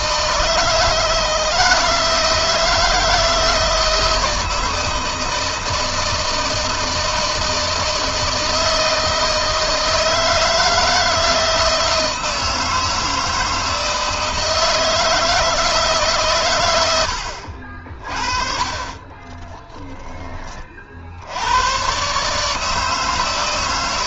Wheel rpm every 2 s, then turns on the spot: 160, 160, 160, 160, 160, 160, 160, 160, 100, 30, 60, 160.
18-20